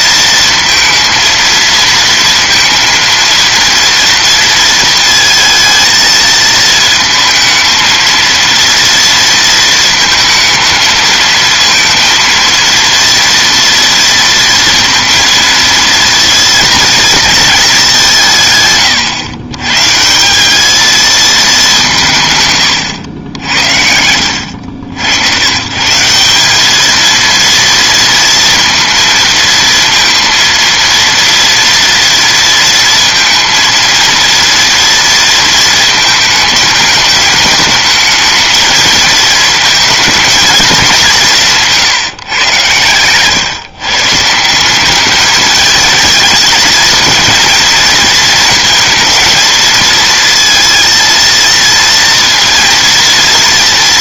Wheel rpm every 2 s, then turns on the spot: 230, 230, 230, 220, 230, 220, 230, 230, 230, 140, 200, 130, 80, 200, 230, 230, 230, 230, 220, 220, 220, 120, 180, 220, 230, 230, 230.
none